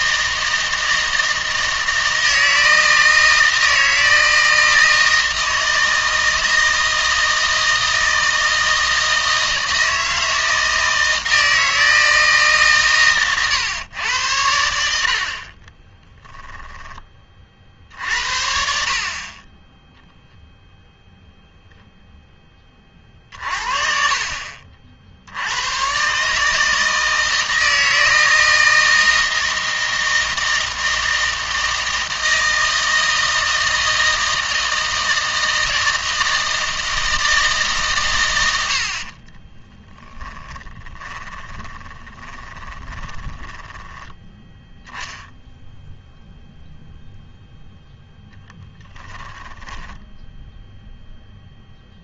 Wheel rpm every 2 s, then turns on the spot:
160, 160, 160, 160, 160, 160, 150, 80, 10, 60, 0, 30, 60, 160, 160, 160, 160, 160, 160, 80, 20, 20, 0, 0, 10, 0.
40-44 48-50